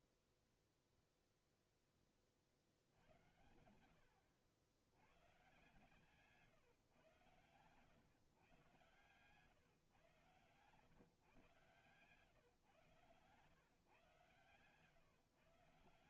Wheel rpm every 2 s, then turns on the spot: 0, 60, 80, 140, 120, 130, 130, 130.
none